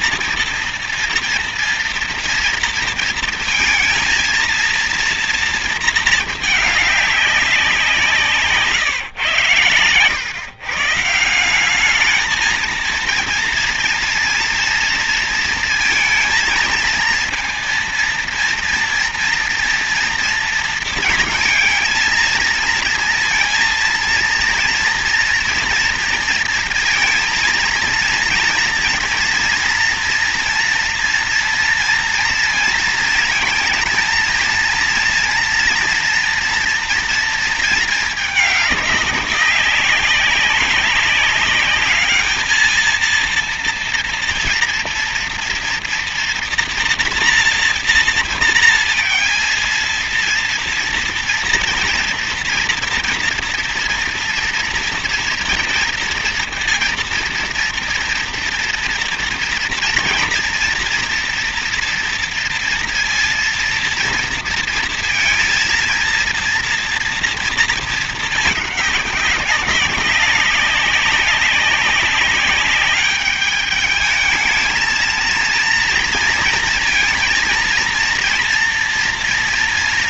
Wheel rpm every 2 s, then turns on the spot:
230, 230, 230, 210, 140, 150, 230, 230, 230, 240, 230, 220, 230, 230, 230, 230, 230, 230, 240, 210, 200, 220, 230, 240, 230, 230, 230, 230, 230, 230, 240, 230, 230, 230, 200, 200, 200, 220, 230, 230.
none